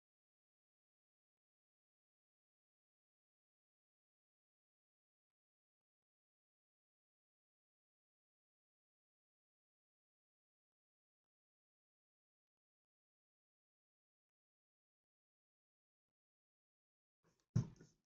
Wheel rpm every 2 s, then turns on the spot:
0, 0, 0, 0, 0, 0, 0, 0, 0.
none